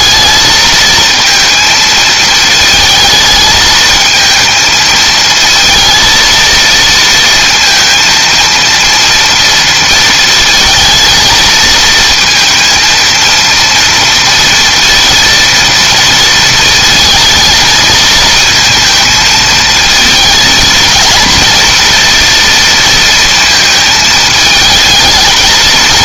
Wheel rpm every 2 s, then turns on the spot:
220, 220, 220, 230, 230, 220, 230, 230, 230, 220, 230, 230, 220.
none